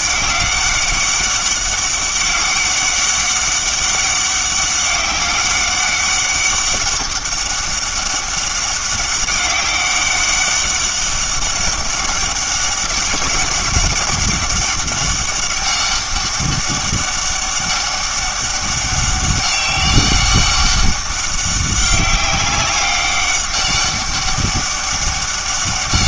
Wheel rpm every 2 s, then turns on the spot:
200, 200, 190, 200, 200, 200, 200, 200, 200, 200, 200, 200, 200.
none